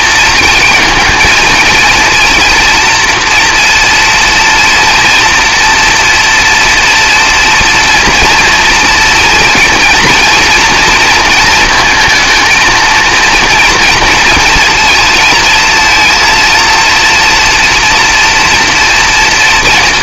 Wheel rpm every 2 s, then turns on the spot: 230, 230, 230, 230, 230, 230, 230, 230, 230, 240.
none